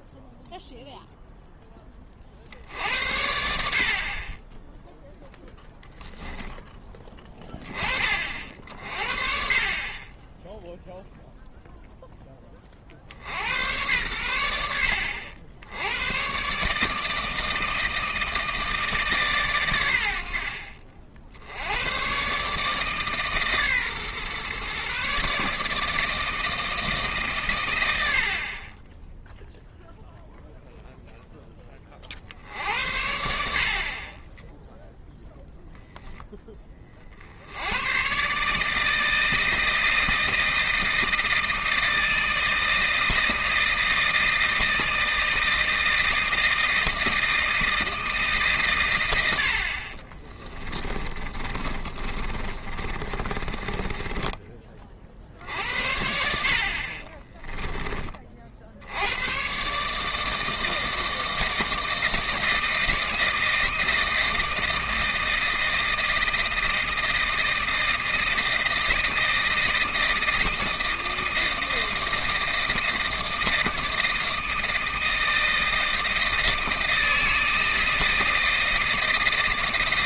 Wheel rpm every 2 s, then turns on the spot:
0, 70, 10, 10, 50, 0, 40, 70, 140, 160, 50, 150, 130, 160, 30, 0, 60, 0, 20, 150, 160, 160, 160, 170, 130, 20, 30, 30, 50, 70, 160, 160, 160, 160, 160, 160, 160, 160, 160, 160.
50-54